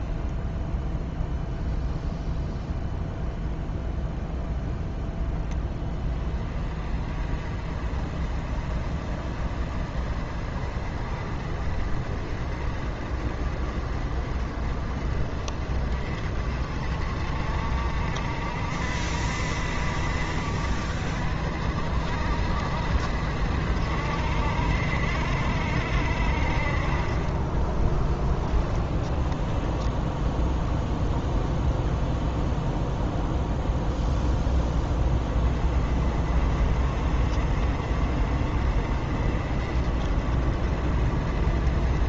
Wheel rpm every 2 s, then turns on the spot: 0, 0, 10, 30, 40, 40, 40, 40, 50, 60, 60, 60, 60, 40, 20, 0, 0, 10, 40, 40, 50.
28-30